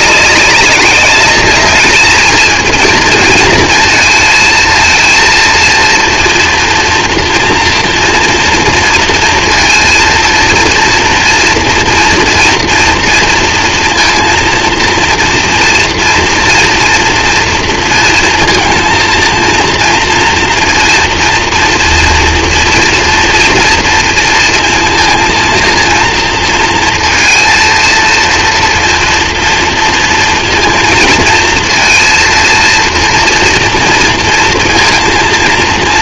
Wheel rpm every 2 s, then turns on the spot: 190, 230, 220, 230, 230, 230, 240, 230, 230, 230, 230, 230, 230, 230, 230, 230, 230, 230.
none